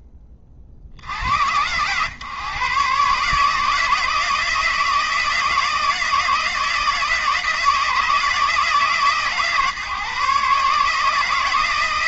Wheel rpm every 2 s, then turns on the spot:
40, 140, 160, 160, 140, 160.
none